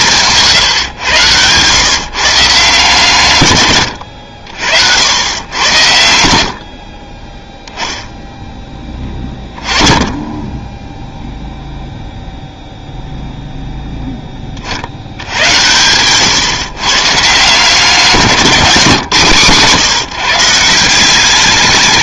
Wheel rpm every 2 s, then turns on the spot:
130, 140, 70, 60, 10, 10, 0, 40, 130, 170, 160.
none